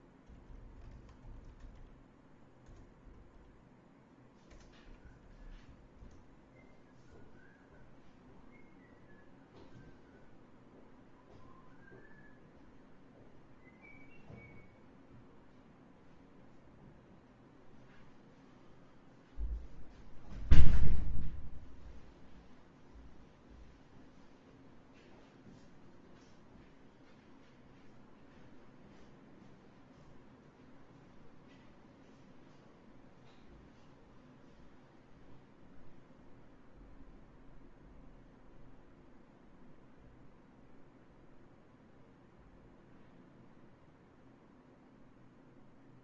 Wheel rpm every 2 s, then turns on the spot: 0, 0, 0, 0, 0, 0, 0, 0, 0, 0, 0, 0, 0, 0, 0, 0, 0, 0, 0, 0, 0, 0, 0.
none